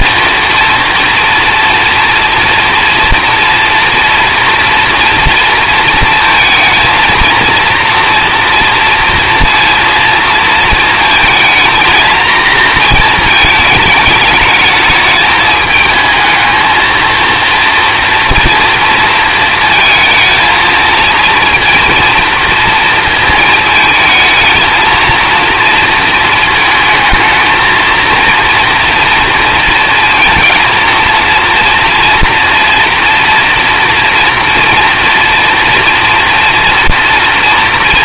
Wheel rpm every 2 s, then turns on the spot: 230, 240, 230, 230, 230, 230, 230, 210, 220, 230, 230, 230, 220, 220, 230, 230, 240, 230, 230.
none